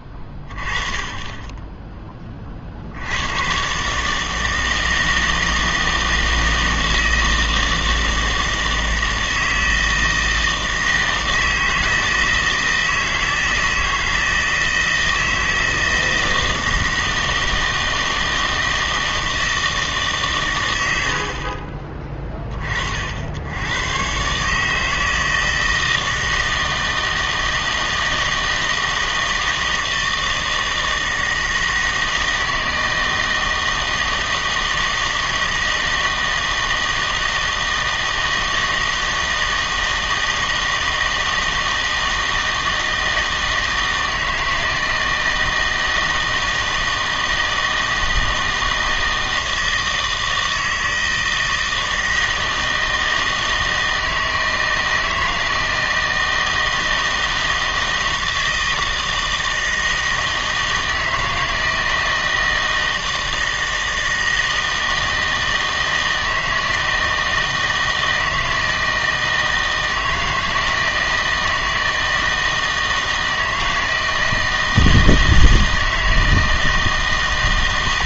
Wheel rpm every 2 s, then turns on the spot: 20, 50, 160, 160, 160, 160, 160, 160, 160, 160, 120, 30, 150, 160, 160, 160, 160, 160, 160, 160, 160, 160, 160, 160, 160, 160, 160, 160, 160, 160, 160, 160, 160, 160, 160, 160, 160, 160, 160.
none